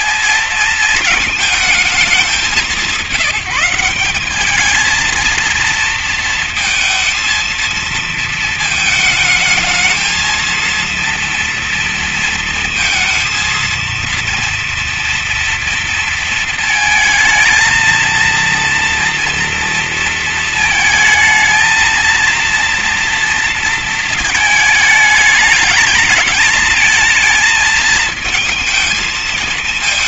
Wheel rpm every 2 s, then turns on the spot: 220, 180, 230, 230, 220, 230, 230, 230, 220, 230, 220, 230, 210, 220, 220.
none